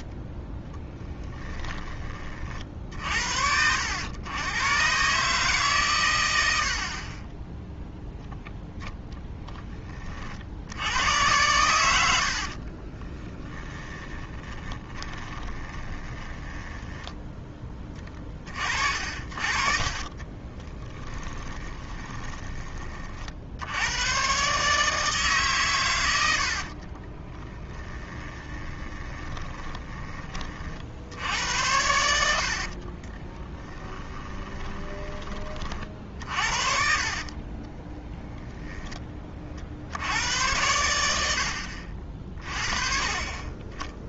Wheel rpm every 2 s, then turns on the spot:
20, 50, 120, 70, 0, 90, 40, 20, 10, 40, 20, 30, 150, 50, 30, 60, 50, 20, 50, 10, 90, 30.
0-2 12-18 20-22 26-30 32-36